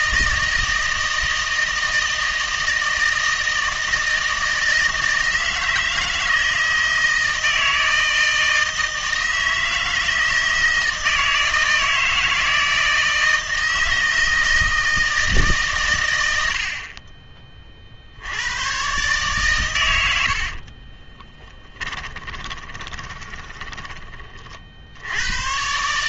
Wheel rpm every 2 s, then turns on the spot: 160, 160, 160, 160, 160, 160, 160, 160, 60, 110, 30, 30, 60.
20-24